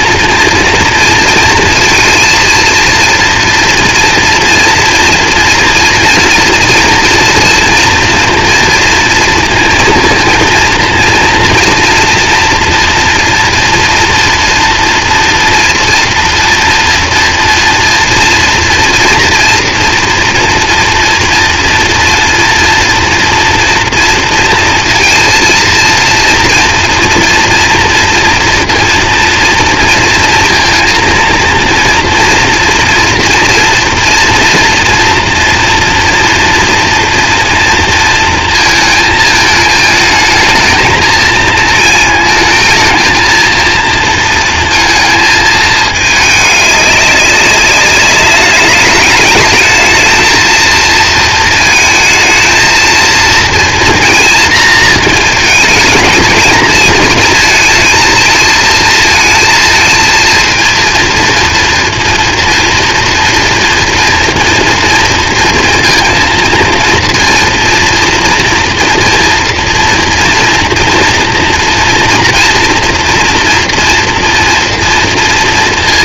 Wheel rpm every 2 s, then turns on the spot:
230, 230, 230, 230, 230, 230, 230, 230, 230, 240, 230, 230, 230, 230, 230, 230, 230, 230, 240, 220, 220, 220, 230, 200, 200, 230, 230, 230, 220, 220, 230, 230, 230, 230, 230, 230, 240, 230.
none